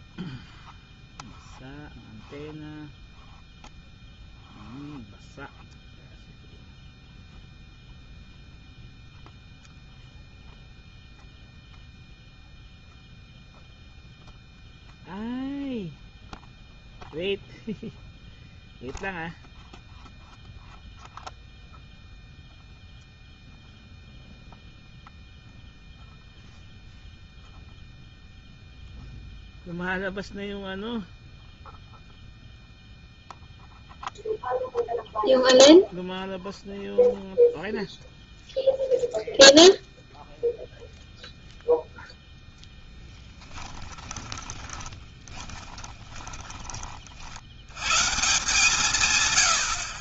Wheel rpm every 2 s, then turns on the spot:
0, 0, 0, 0, 0, 0, 0, 0, 0, 0, 0, 0, 0, 0, 0, 0, 0, 0, 0, 0, 0, 10, 10, 30, 140.
44-46